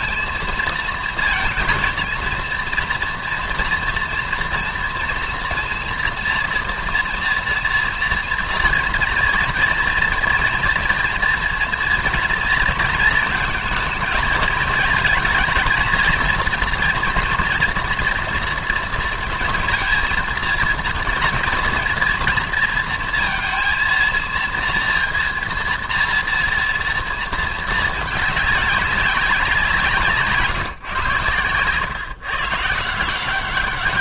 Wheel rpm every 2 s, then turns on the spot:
230, 230, 230, 230, 230, 230, 230, 230, 230, 230, 230, 230, 230, 230, 200, 150, 140.
none